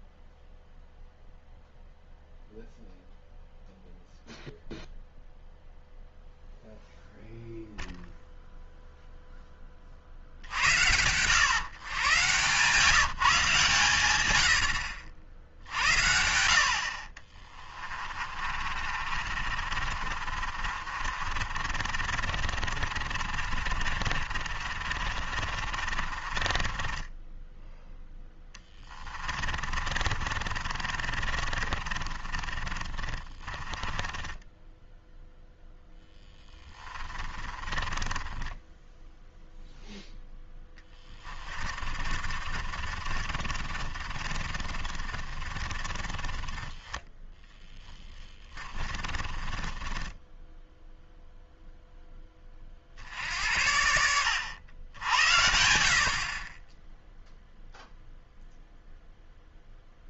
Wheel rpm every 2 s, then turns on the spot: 0, 0, 0, 0, 0, 110, 160, 70, 60, 40, 50, 40, 40, 20, 10, 40, 30, 10, 20, 0, 10, 50, 40, 10, 30, 10, 40, 90, 10, 0.
18-38 40-50